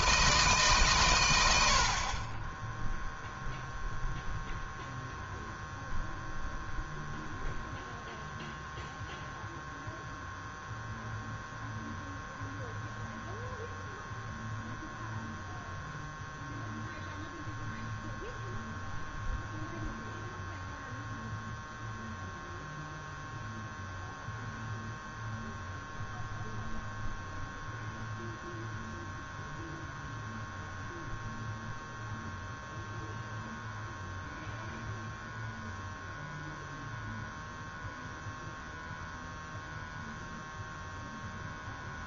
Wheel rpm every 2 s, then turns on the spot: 150, 20, 0, 0, 0, 0, 0, 0, 0, 0, 0, 0, 0, 0, 0, 0, 0, 0, 0, 0, 0.
none